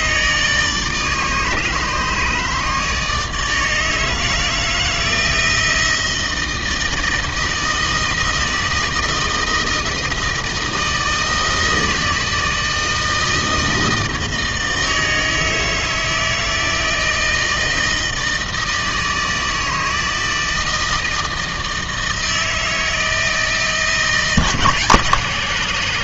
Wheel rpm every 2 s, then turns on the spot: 150, 160, 160, 160, 160, 160, 160, 160, 160, 160, 160, 160, 140.
none